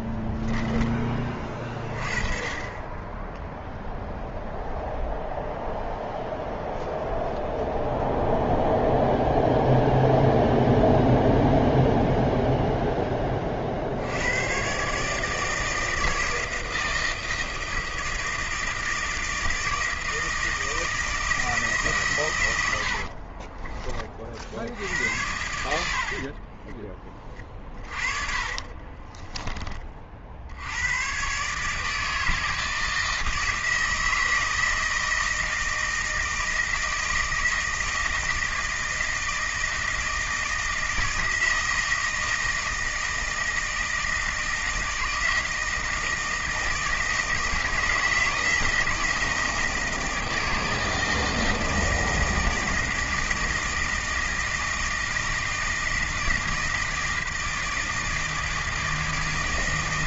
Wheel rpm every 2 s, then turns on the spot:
10, 20, 0, 0, 0, 0, 0, 130, 160, 160, 160, 90, 70, 30, 50, 80, 160, 160, 160, 160, 160, 160, 160, 160, 160, 160, 160, 160, 160, 160.
0-2 26-30